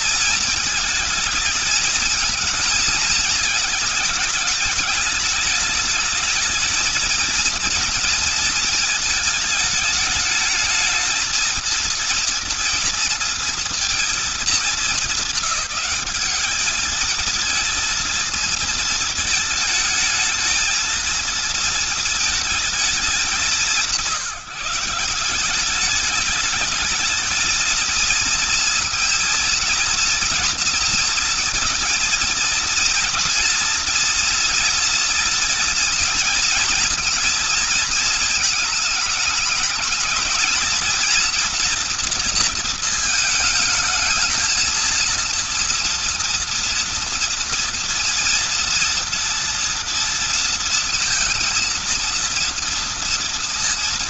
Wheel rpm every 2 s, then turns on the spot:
230, 230, 220, 220, 230, 220, 230, 220, 210, 230, 220, 220, 180, 210, 230, 240, 230, 230, 230, 220, 230, 230, 220, 230, 230, 230, 230.
none